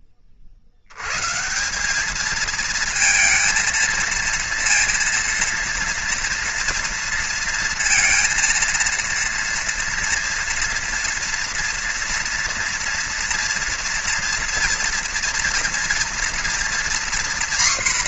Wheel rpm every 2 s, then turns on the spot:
80, 230, 230, 230, 230, 230, 230, 230, 240.
none